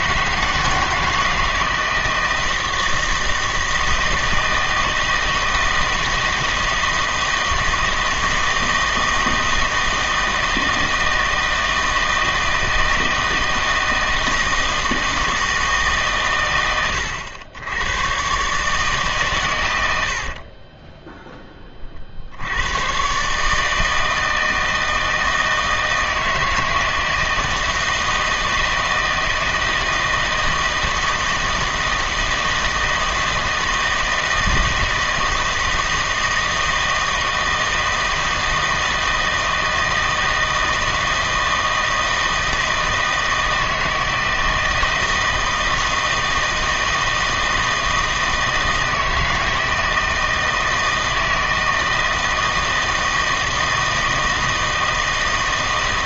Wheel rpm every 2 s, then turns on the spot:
170, 160, 160, 170, 160, 160, 160, 160, 90, 140, 10, 110, 160, 160, 160, 160, 160, 160, 160, 160, 160, 160, 160, 160, 160, 160, 160, 160.
20-22